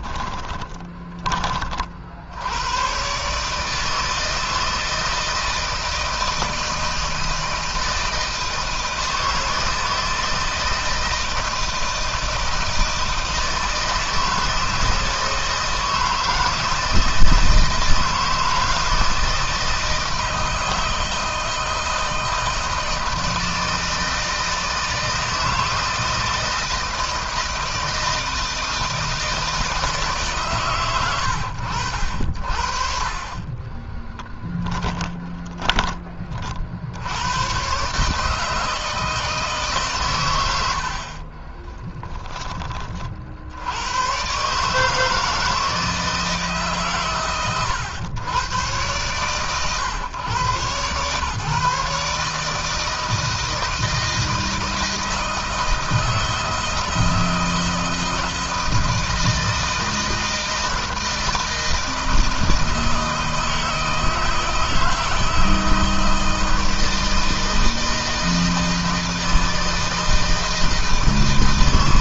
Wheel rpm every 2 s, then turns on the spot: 20, 120, 160, 160, 160, 170, 160, 160, 160, 170, 160, 160, 160, 160, 160, 110, 50, 10, 90, 160, 50, 40, 150, 130, 120, 120, 160, 160, 160, 160, 160, 160, 160, 160, 160, 160.
34-36 40-42